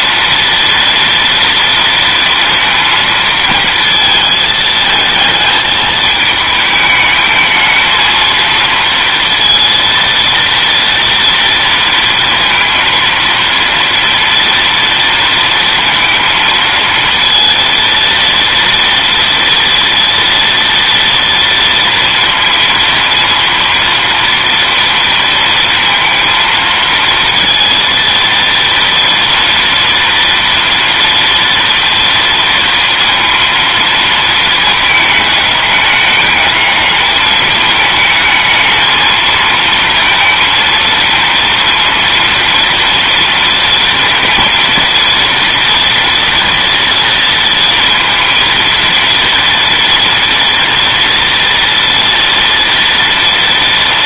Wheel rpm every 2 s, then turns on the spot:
230, 230, 220, 220, 230, 230, 230, 230, 230, 230, 230, 230, 230, 230, 230, 230, 230, 220, 210, 220, 230, 230, 230, 230, 230, 230, 230.
none